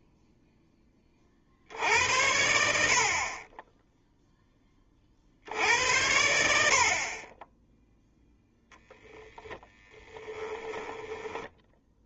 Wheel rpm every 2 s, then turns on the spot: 0, 70, 20, 20, 10, 10.
8-12